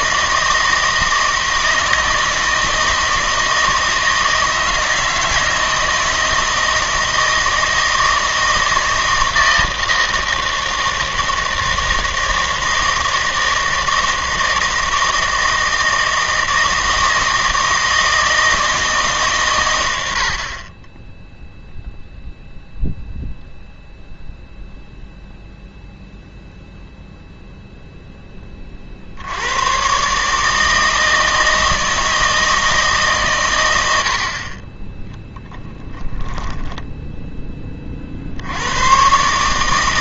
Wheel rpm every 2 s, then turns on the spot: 160, 160, 160, 160, 160, 160, 160, 160, 160, 160, 40, 0, 0, 0, 30, 160, 160, 30, 0, 90.
none